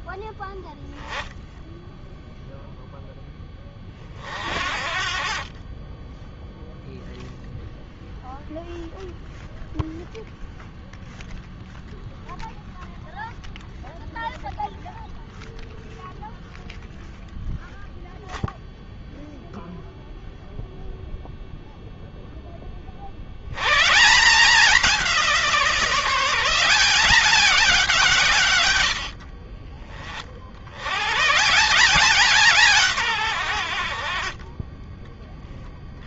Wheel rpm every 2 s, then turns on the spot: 10, 0, 50, 0, 0, 0, 0, 0, 0, 0, 0, 20, 180, 170, 130, 50, 170, 30.
none